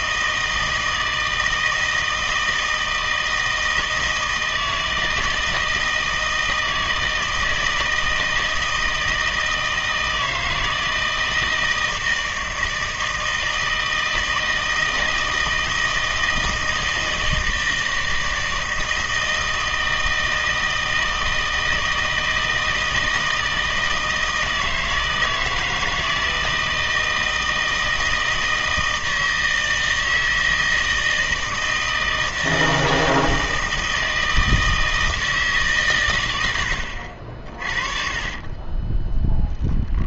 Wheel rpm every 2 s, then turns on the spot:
160, 160, 160, 160, 160, 160, 160, 160, 160, 160, 160, 160, 160, 160, 160, 160, 160, 160, 70, 10.
38-40